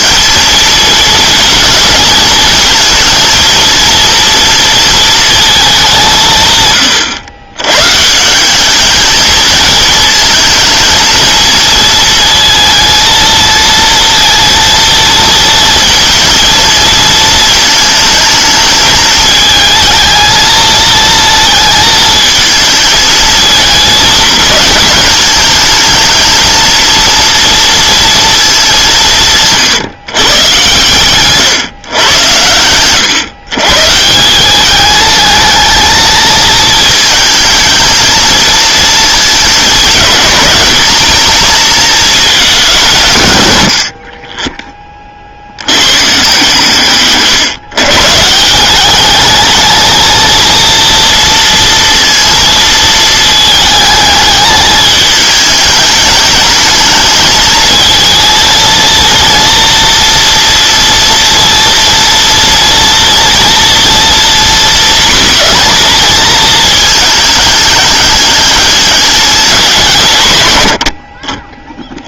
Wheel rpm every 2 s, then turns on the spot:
230, 220, 230, 140, 190, 220, 230, 230, 220, 210, 220, 230, 220, 220, 210, 130, 110, 190, 220, 230, 200, 200, 20, 140, 170, 230, 230, 210, 210, 230, 230, 230, 240, 230, 210, 100.
none